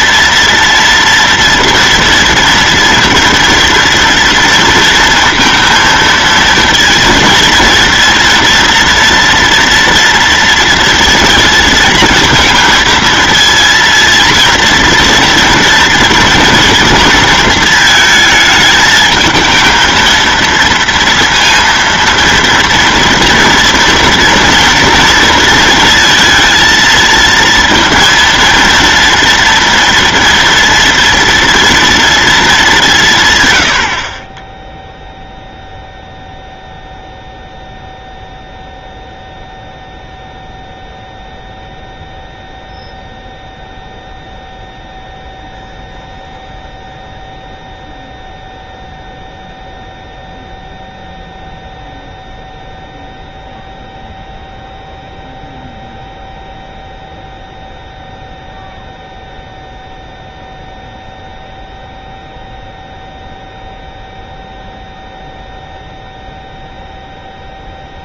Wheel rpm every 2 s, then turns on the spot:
230, 230, 230, 230, 240, 230, 220, 230, 230, 220, 230, 230, 230, 230, 230, 230, 200, 0, 0, 0, 0, 0, 0, 0, 0, 0, 0, 0, 0, 0, 0, 0, 0, 0.
none